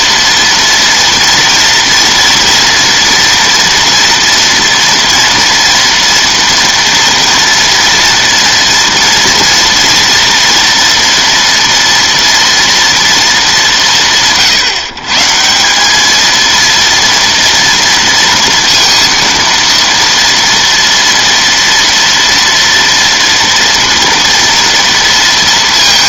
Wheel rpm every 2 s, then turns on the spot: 230, 240, 230, 240, 230, 230, 230, 150, 230, 230, 230, 230, 230.
none